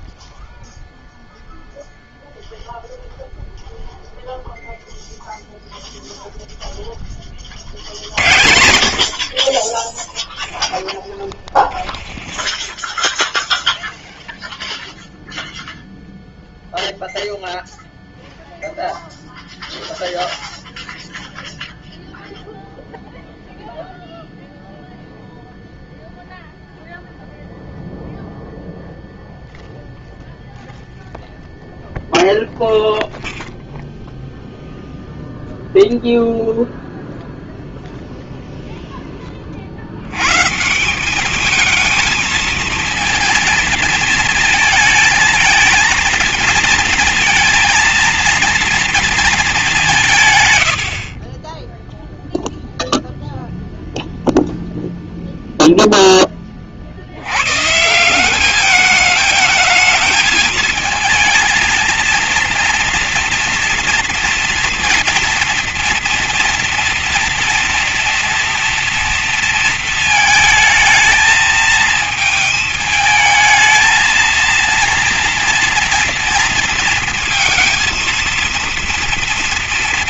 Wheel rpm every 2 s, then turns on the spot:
0, 0, 0, 0, 70, 10, 20, 0, 0, 0, 0, 0, 0, 0, 0, 0, 0, 0, 0, 0, 140, 220, 220, 230, 230, 110, 0, 0, 30, 200, 220, 230, 230, 230, 230, 220, 220, 230, 230, 230.
none